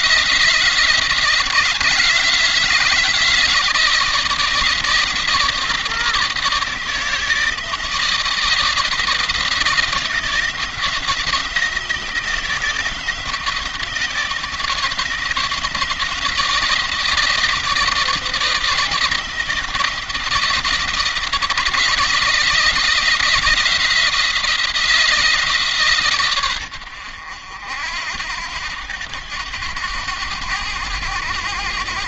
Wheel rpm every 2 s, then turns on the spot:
160, 170, 160, 160, 170, 170, 160, 160, 170, 170, 170, 170, 160, 80, 90, 100.
none